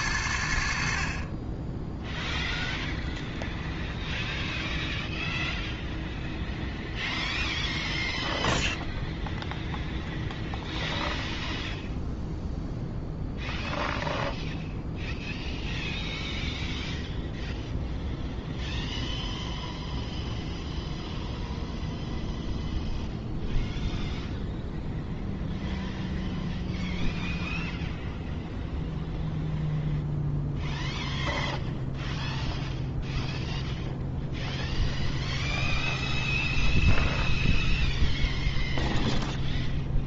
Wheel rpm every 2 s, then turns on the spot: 60, 0, 0, 0, 0, 0, 0, 0, 0, 0, 0, 0, 0, 0, 0, 0, 0, 0, 0, 0.
none